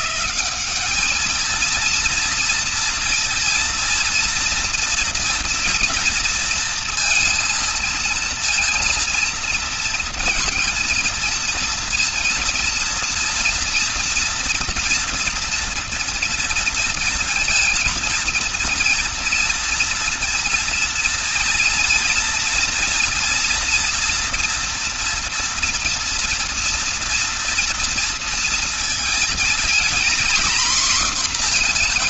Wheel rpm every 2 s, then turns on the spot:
200, 230, 230, 230, 230, 230, 230, 240, 240, 230, 230, 230, 240, 230, 220, 240.
none